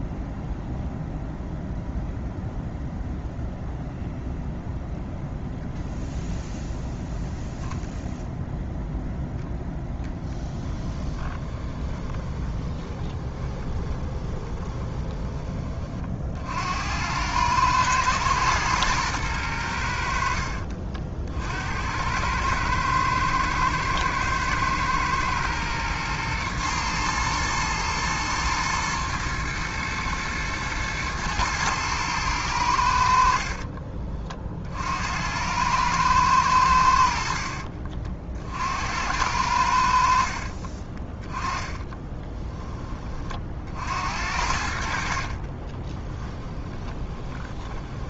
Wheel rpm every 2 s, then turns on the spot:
0, 0, 0, 0, 0, 10, 10, 20, 90, 110, 50, 110, 120, 120, 120, 110, 80, 60, 90, 70, 30, 20, 50, 20.
10-16 40-42 44-48